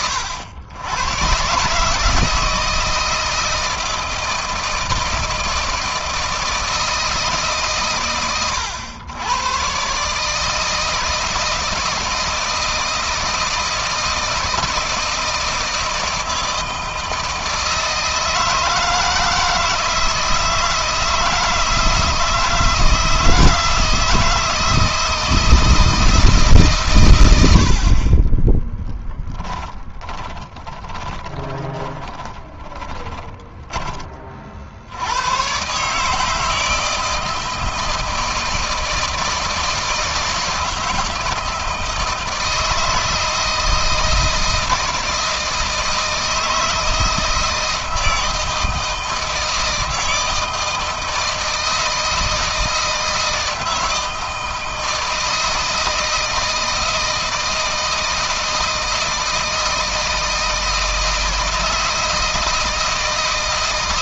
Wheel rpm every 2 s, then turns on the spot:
110, 160, 160, 160, 110, 160, 160, 160, 160, 160, 160, 160, 160, 140, 30, 20, 10, 70, 160, 160, 160, 160, 160, 160, 160, 160, 160, 160, 160, 160, 160, 160.
28-34